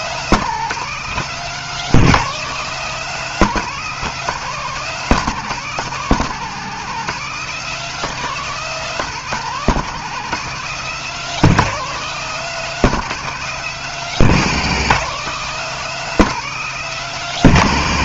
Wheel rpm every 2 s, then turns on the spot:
200, 200, 190, 180, 190, 190, 200, 190, 200.
none